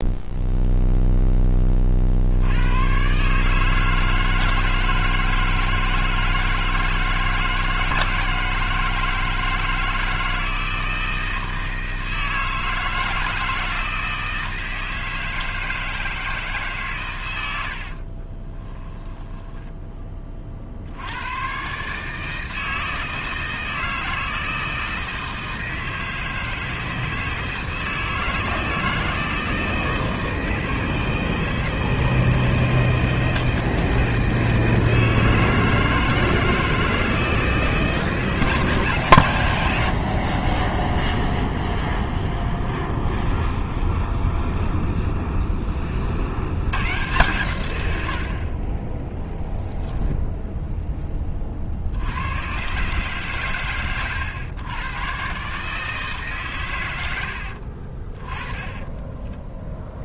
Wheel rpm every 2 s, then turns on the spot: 0, 110, 160, 160, 160, 160, 160, 160, 140, 10, 70, 160, 160, 160, 160, 160, 160, 160, 160, 150, 10, 0, 0, 110, 30, 10, 130, 110, 110, 20.
18-20 58-60